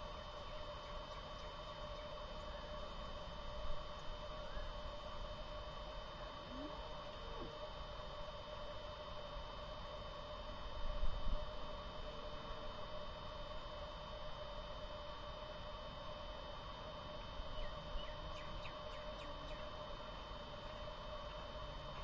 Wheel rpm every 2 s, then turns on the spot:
0, 0, 0, 0, 0, 0, 0, 0, 0, 0, 0.
none